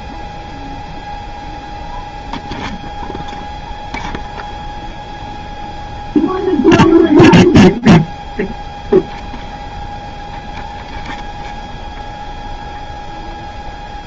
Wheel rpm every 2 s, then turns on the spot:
0, 0, 0, 0, 0, 0, 0.
none